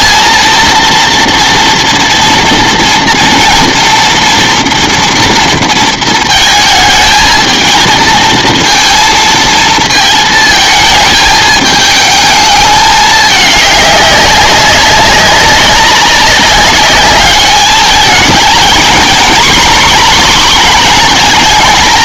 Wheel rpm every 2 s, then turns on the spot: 230, 230, 230, 220, 230, 220, 210, 200, 200, 220, 230.
none